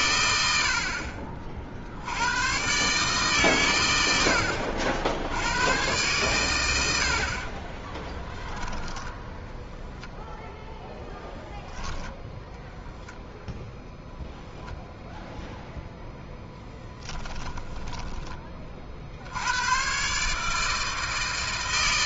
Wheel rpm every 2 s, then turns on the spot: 70, 120, 50, 110, 10, 0, 0, 0, 0, 20, 150.
8-10